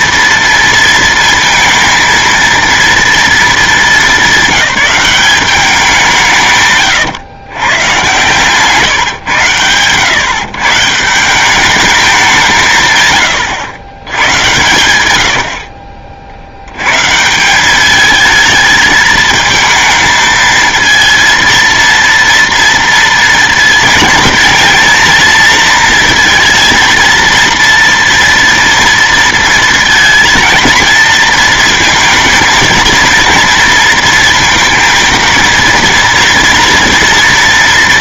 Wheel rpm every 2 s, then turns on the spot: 230, 230, 200, 130, 140, 150, 140, 110, 100, 220, 220, 230, 230, 230, 230, 230, 220, 230, 240.
6-8